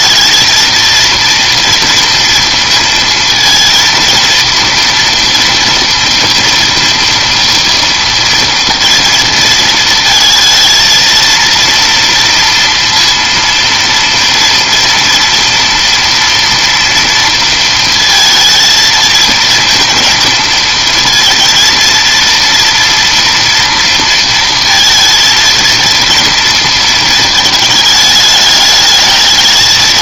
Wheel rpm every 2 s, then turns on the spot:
220, 230, 230, 230, 230, 220, 230, 230, 230, 230, 230, 230, 230, 230, 210.
none